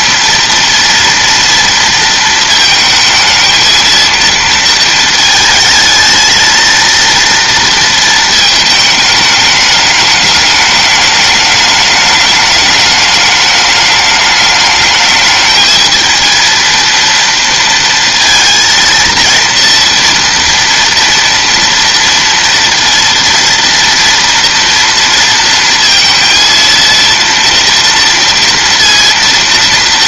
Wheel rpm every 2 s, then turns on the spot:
230, 220, 230, 220, 220, 210, 210, 210, 230, 230, 230, 230, 230, 230, 230.
none